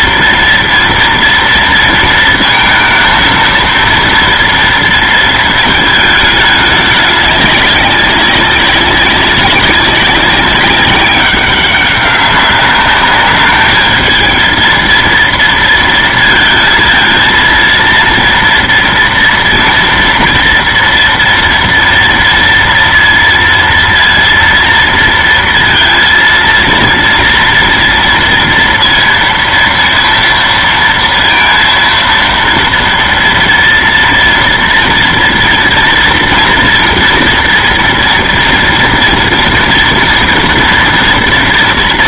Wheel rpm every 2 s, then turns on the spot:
240, 230, 230, 210, 190, 190, 200, 220, 230, 230, 230, 230, 230, 230, 230, 230, 230, 230, 230, 230, 230.
none